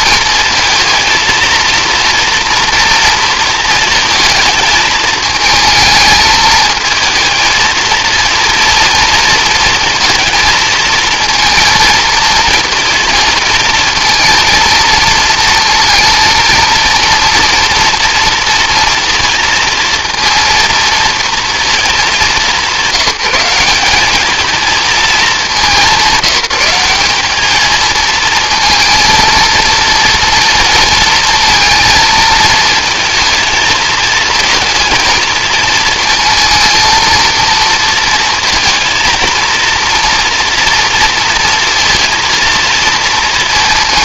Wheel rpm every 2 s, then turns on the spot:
230, 230, 220, 220, 230, 230, 230, 230, 230, 230, 230, 170, 210, 190, 230, 230, 230, 230, 220, 230, 240, 230.
none